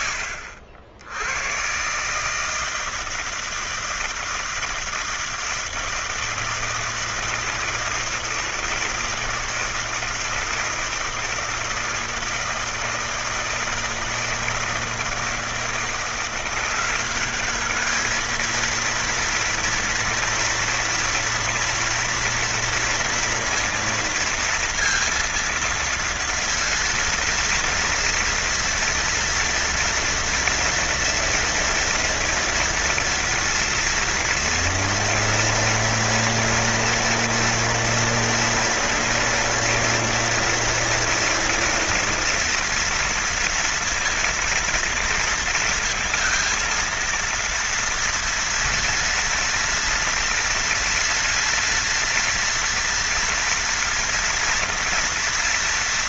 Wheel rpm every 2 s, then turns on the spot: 80, 160, 160, 160, 160, 160, 160, 160, 180, 230, 230, 240, 230, 230, 230, 230, 230, 230, 230, 230, 230, 230, 230, 230, 230, 230, 230, 230.
none